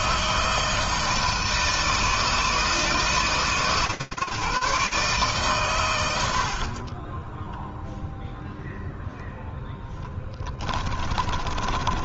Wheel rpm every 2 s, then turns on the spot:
160, 160, 150, 50, 0, 20.
6-8 10-12